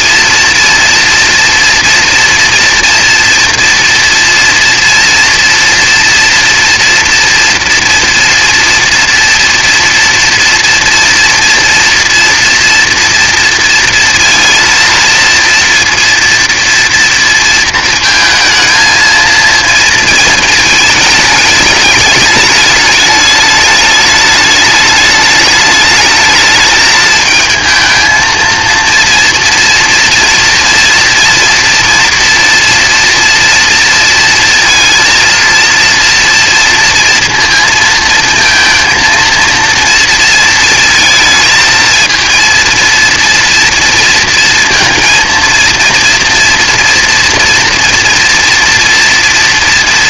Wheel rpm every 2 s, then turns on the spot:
230, 230, 230, 230, 230, 240, 230, 230, 230, 230, 220, 210, 210, 220, 230, 230, 230, 230, 230, 230, 230, 230, 230, 230, 230.
none